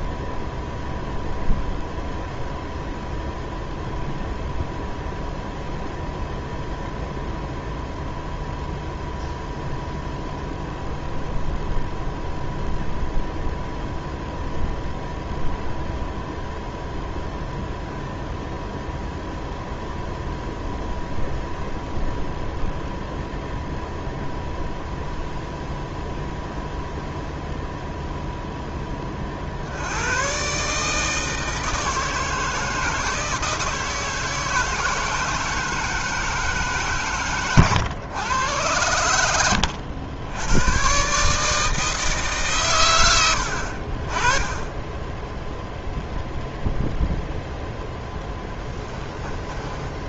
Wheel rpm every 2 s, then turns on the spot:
0, 0, 0, 0, 0, 0, 0, 0, 0, 0, 0, 0, 0, 0, 10, 150, 160, 160, 150, 100, 110, 130, 10, 0, 10.
48-50